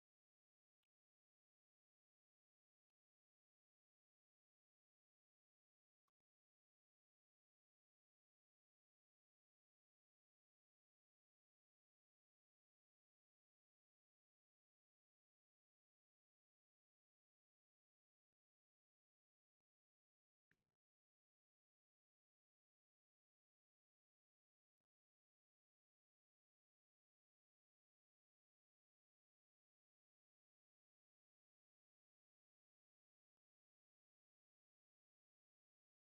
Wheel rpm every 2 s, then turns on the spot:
0, 0, 0, 0, 0, 0, 0, 0, 0, 0, 0, 0, 0, 0, 0, 0, 0, 0.
none